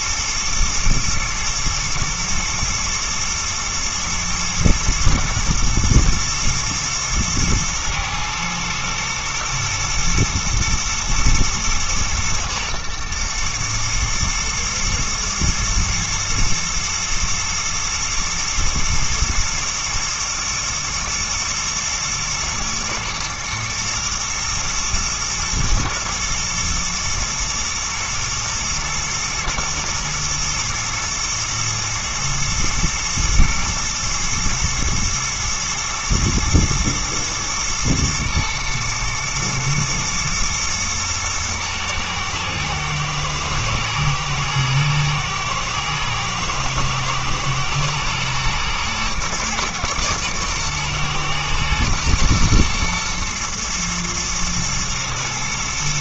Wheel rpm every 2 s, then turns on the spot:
120, 110, 120, 110, 110, 120, 110, 110, 110, 120, 120, 120, 110, 110, 120, 120, 120, 110, 110, 110, 110, 110, 110, 120, 120, 120, 120, 110.
none